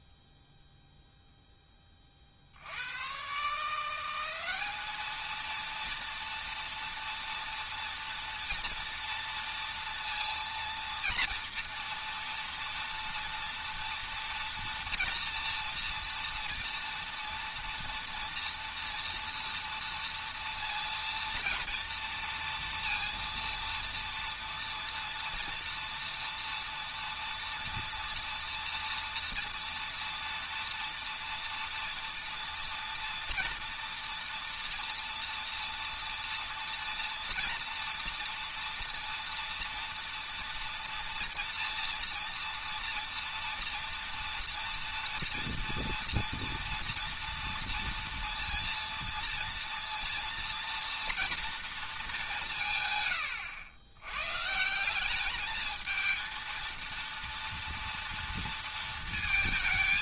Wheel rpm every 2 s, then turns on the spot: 0, 80, 200, 230, 230, 230, 230, 230, 230, 230, 230, 230, 230, 230, 230, 230, 230, 230, 230, 230, 230, 230, 230, 230, 230, 240, 140, 170, 230, 230.
none